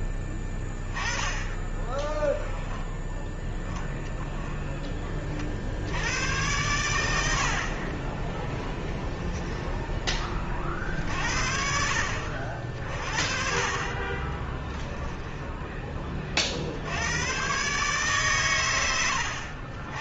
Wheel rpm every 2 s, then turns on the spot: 20, 10, 10, 100, 10, 40, 40, 20, 70, 100.
6-10 14-16